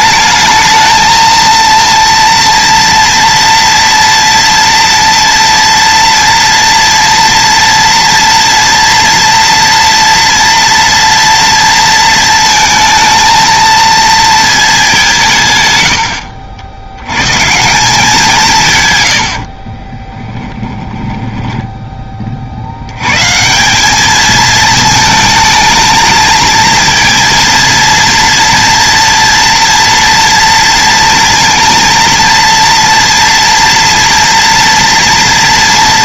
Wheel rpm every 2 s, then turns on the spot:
220, 230, 230, 230, 240, 230, 220, 190, 90, 120, 10, 120, 220, 230, 230, 230, 230, 230.
18-22